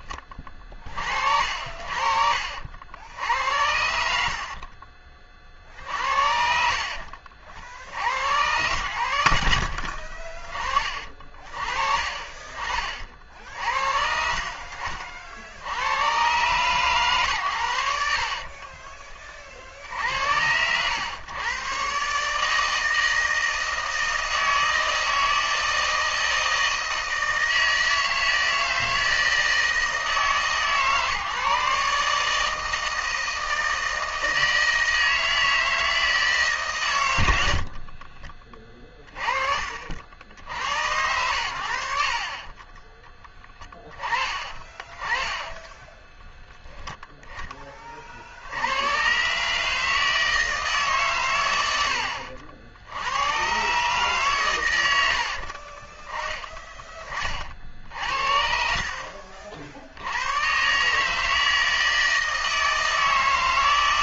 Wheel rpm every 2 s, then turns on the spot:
40, 70, 40, 60, 80, 40, 50, 50, 120, 20, 110, 160, 160, 160, 160, 150, 160, 160, 110, 20, 90, 20, 20, 10, 130, 130, 80, 100, 20, 60, 150, 160.
4-8 42-44